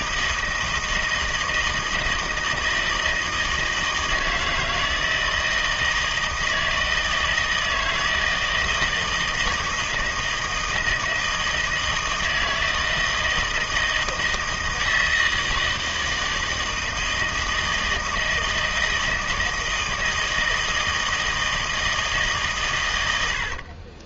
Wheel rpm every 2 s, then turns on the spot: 160, 160, 160, 160, 160, 160, 160, 160, 160, 160, 160, 130.
none